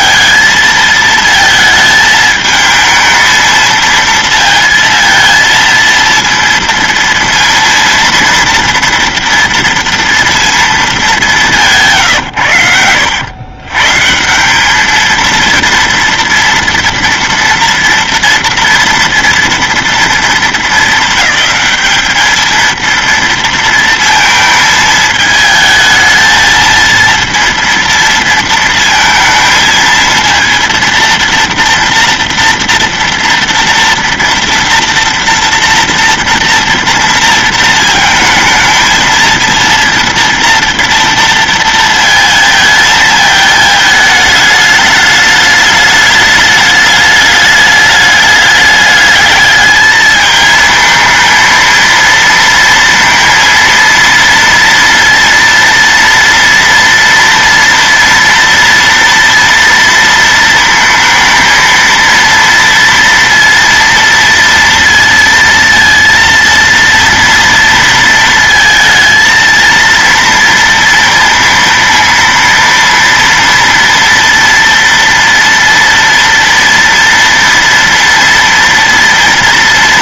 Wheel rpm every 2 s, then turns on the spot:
220, 220, 230, 230, 230, 230, 130, 160, 230, 230, 220, 210, 230, 220, 230, 230, 230, 230, 230, 220, 230, 230, 210, 210, 210, 220, 230, 230, 230, 230, 230, 230, 230, 230, 230, 230, 230, 240, 230, 230.
none